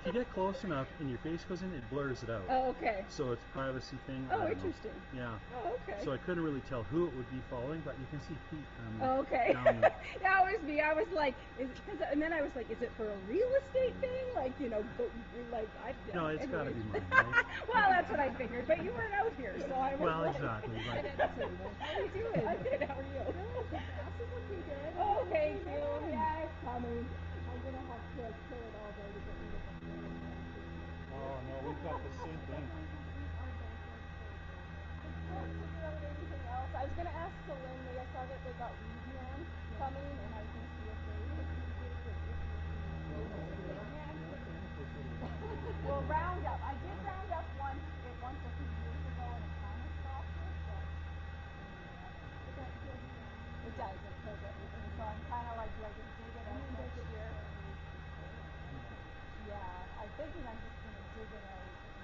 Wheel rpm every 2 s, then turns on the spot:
0, 0, 0, 0, 0, 0, 0, 0, 0, 0, 0, 0, 0, 0, 0, 0, 0, 0, 0, 0, 0, 0, 0, 0, 0, 0, 0, 0, 0, 0, 0.
none